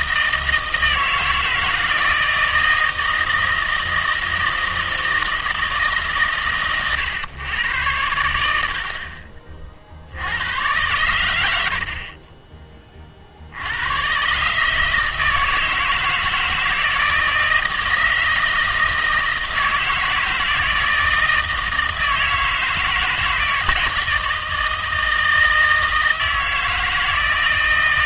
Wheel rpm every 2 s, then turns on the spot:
160, 160, 160, 120, 70, 100, 20, 150, 160, 160, 160, 170, 160, 160.
none